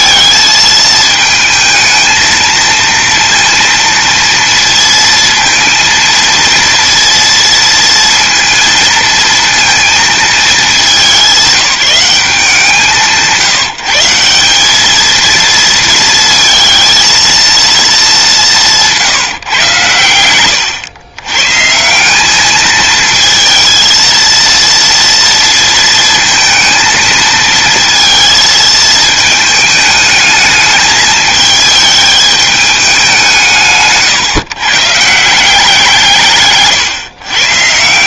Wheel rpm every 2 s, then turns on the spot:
220, 230, 230, 230, 230, 200, 170, 220, 230, 160, 110, 220, 230, 230, 220, 220, 180, 170, 140.
none